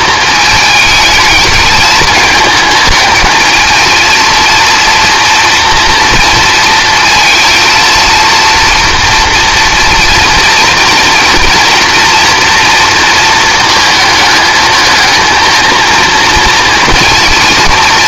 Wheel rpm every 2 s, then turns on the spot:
220, 220, 230, 230, 240, 230, 230, 220, 230.
none